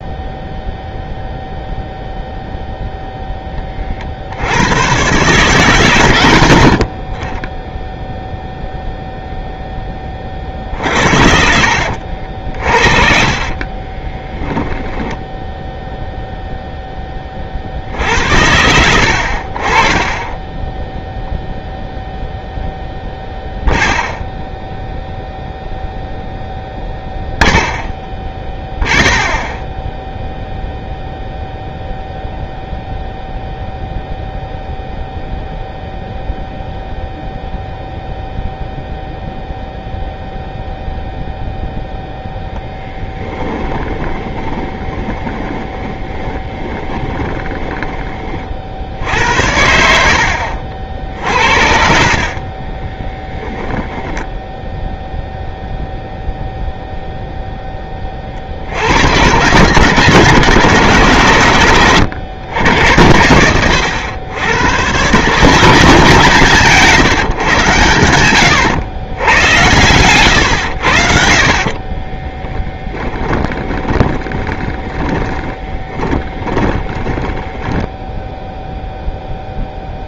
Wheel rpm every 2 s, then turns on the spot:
0, 0, 80, 80, 0, 40, 50, 10, 0, 80, 10, 0, 0, 0, 0, 0, 0, 0, 0, 0, 0, 10, 20, 20, 40, 70, 30, 0, 0, 50, 130, 100, 110, 150, 100, 90, 10, 20, 20, 0.
10-12 44-48 52-54 72-78